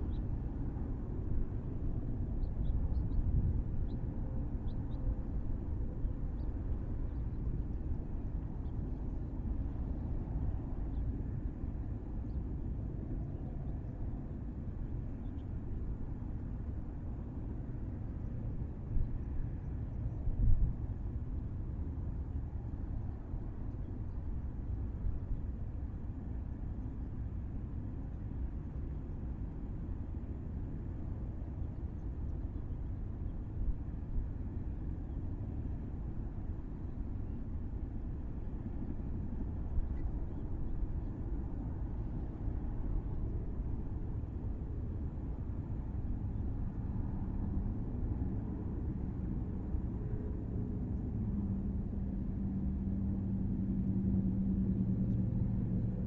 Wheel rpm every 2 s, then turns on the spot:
0, 0, 0, 0, 0, 0, 0, 0, 0, 0, 0, 0, 0, 0, 0, 0, 0, 0, 0, 0, 0, 0, 0, 0, 0, 0, 0, 0.
none